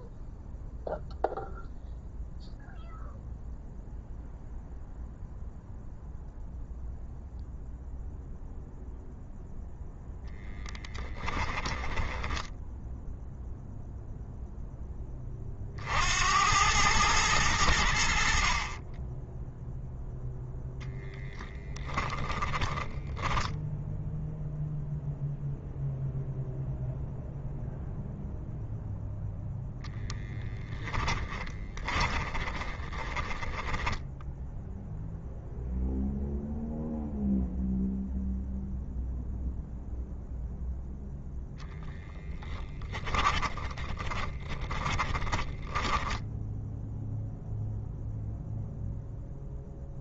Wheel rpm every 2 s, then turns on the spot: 0, 0, 0, 0, 0, 10, 0, 20, 110, 30, 0, 10, 0, 0, 0, 20, 30, 0, 0, 0, 0, 10, 20, 10, 0.
10-12 22-24 30-34 42-46